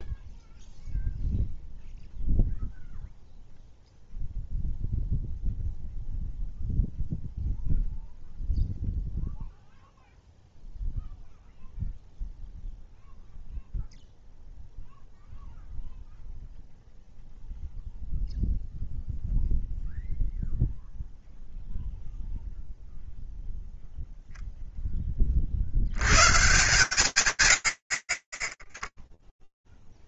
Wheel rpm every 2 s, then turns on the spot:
0, 0, 0, 0, 0, 0, 0, 0, 0, 0, 0, 0, 0, 140, 10.
none